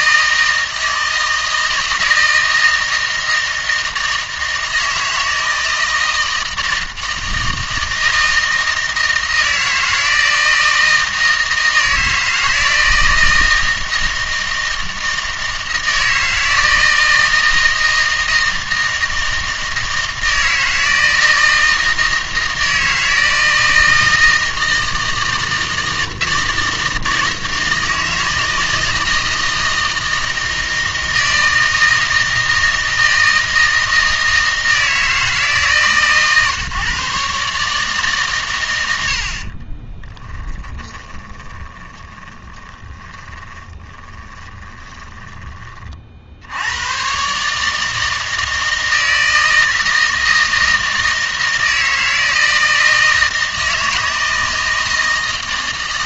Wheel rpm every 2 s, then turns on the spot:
160, 160, 160, 160, 160, 160, 160, 160, 160, 160, 160, 160, 160, 160, 160, 160, 160, 160, 140, 120, 10, 20, 20, 100, 160, 160, 160, 160.
40-46